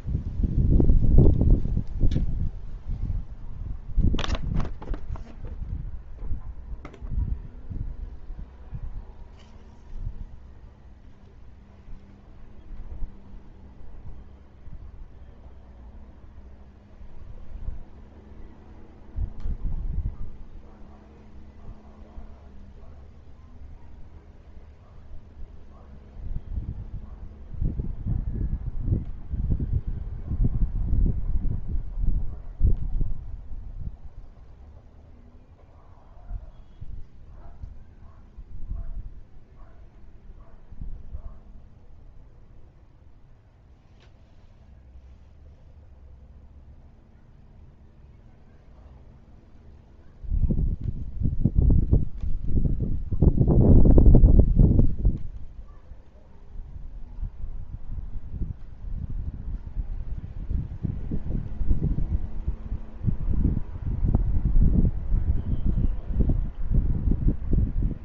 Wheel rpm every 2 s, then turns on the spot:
0, 0, 0, 0, 0, 0, 0, 0, 0, 0, 0, 0, 0, 0, 0, 0, 0, 0, 0, 0, 0, 0, 0, 0, 0, 0, 0, 0, 0, 0, 0, 0, 0, 0.
none